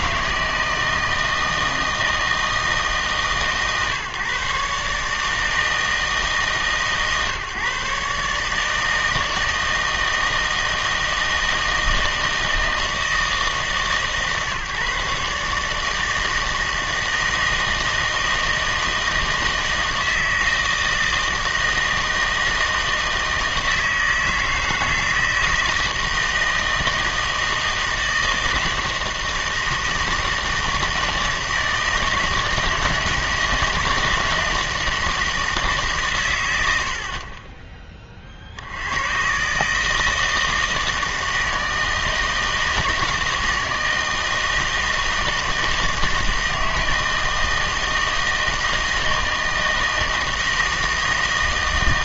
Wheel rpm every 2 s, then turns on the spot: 160, 160, 140, 150, 150, 160, 160, 140, 160, 160, 160, 160, 160, 160, 160, 160, 160, 160, 90, 70, 160, 160, 160, 160, 160, 160.
none